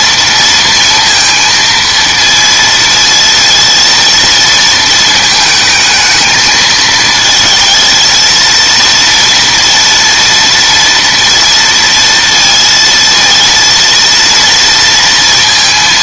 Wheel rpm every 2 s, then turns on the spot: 230, 230, 230, 220, 230, 230, 230, 230.
none